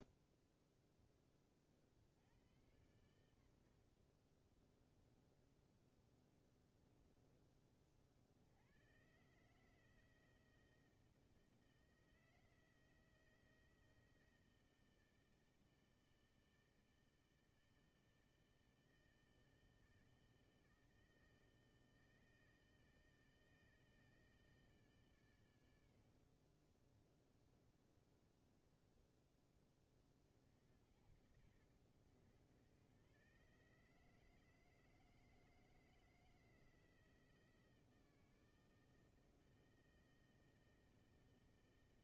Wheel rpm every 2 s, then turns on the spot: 0, 80, 20, 20, 90, 160, 160, 160, 160, 160, 160, 160, 150, 30, 20, 70, 120, 160, 160, 160, 160.
28-30